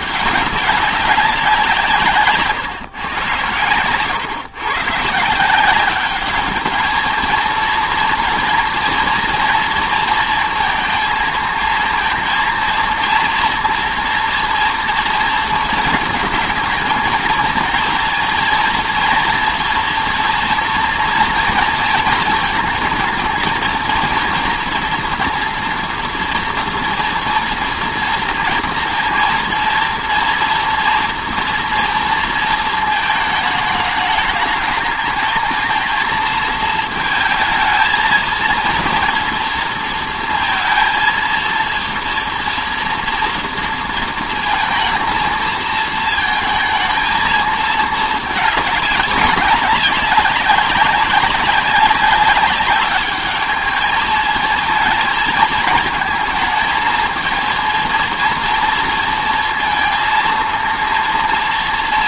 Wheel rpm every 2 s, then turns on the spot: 200, 140, 130, 210, 230, 230, 230, 240, 220, 230, 230, 220, 230, 230, 230, 230, 220, 220, 220, 230, 230, 230, 230, 230, 210, 200, 210, 220, 220, 230, 230.
none